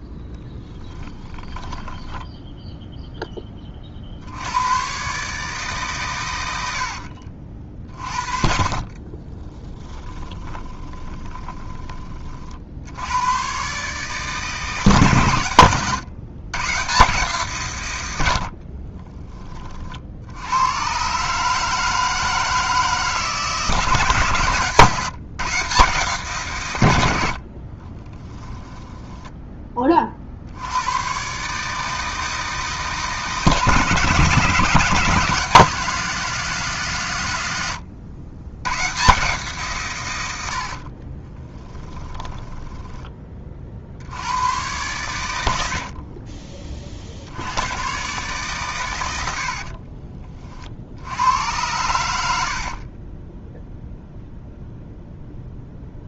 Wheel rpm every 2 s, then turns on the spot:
10, 0, 120, 70, 30, 30, 90, 140, 140, 30, 120, 160, 140, 110, 10, 110, 150, 160, 140, 130, 30, 20, 110, 50, 100, 80, 30, 0.
0-2 8-12 18-20 28-30 40-42 52-54